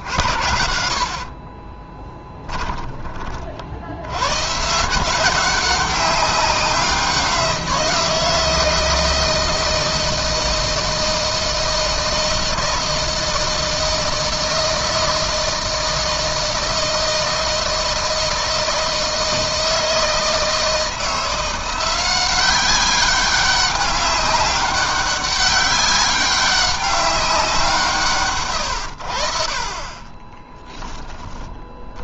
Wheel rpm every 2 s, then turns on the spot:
70, 20, 160, 180, 160, 160, 160, 160, 160, 160, 160, 190, 200, 190, 80, 20.
0-2